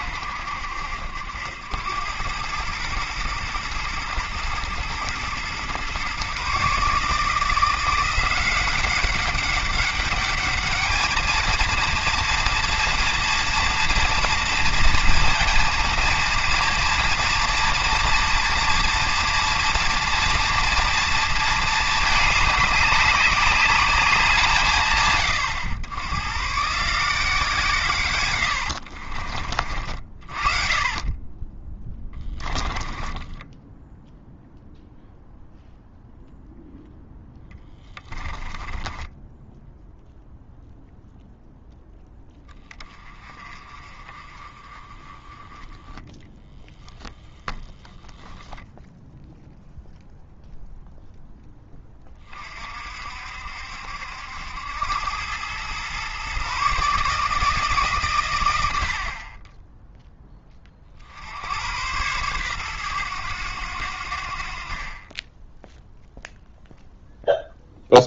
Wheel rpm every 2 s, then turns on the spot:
70, 110, 120, 150, 190, 210, 230, 230, 230, 230, 230, 200, 150, 160, 60, 30, 30, 0, 0, 10, 0, 20, 20, 0, 0, 0, 50, 90, 140, 60, 50, 110, 30, 0.
28-34 38-40